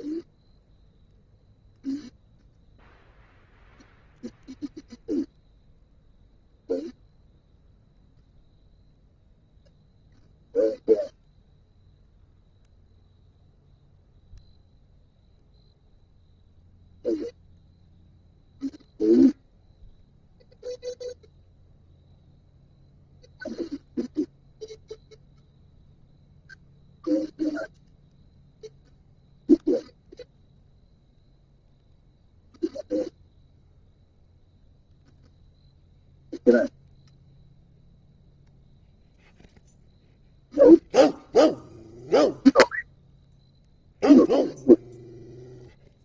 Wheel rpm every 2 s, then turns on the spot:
0, 0, 0, 0, 0, 0, 0, 0, 0, 0, 0, 0, 0, 0, 0, 0, 0, 0, 0, 0, 0, 0, 0.
none